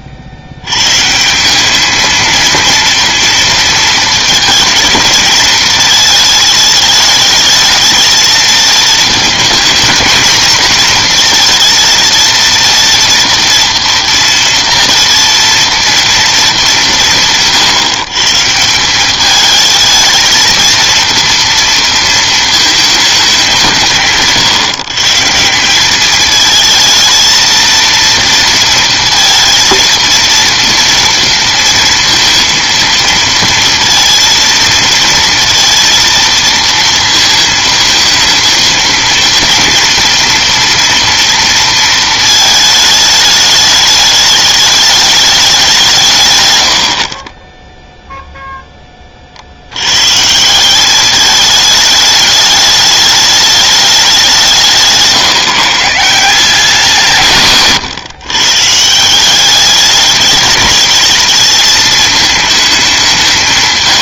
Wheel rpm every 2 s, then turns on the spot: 90, 230, 220, 210, 220, 230, 230, 230, 200, 160, 230, 230, 140, 220, 230, 230, 230, 230, 230, 230, 240, 220, 210, 100, 0, 170, 210, 180, 170, 150, 210, 210.
none